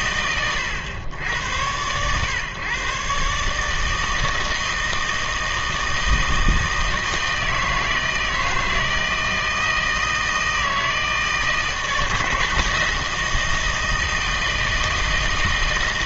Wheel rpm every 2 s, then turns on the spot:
110, 130, 160, 160, 160, 160, 160, 160.
none